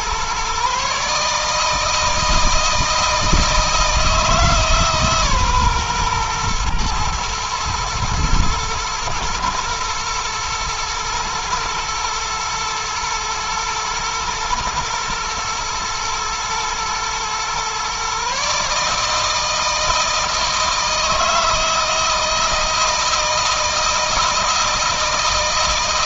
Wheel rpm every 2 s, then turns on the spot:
140, 160, 150, 120, 120, 120, 120, 110, 120, 150, 160, 160, 170.
none